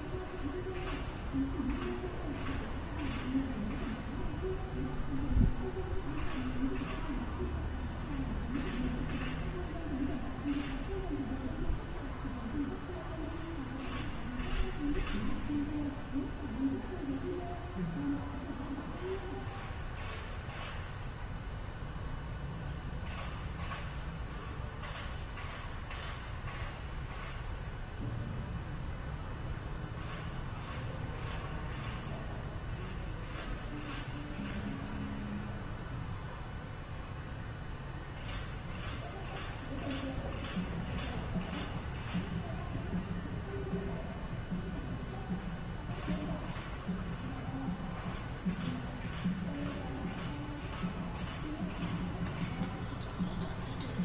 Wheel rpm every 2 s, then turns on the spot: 0, 0, 0, 0, 0, 0, 0, 0, 0, 0, 0, 0, 0, 0, 0, 0, 0, 0, 0, 0, 0, 0, 0, 0, 0, 0, 0.
none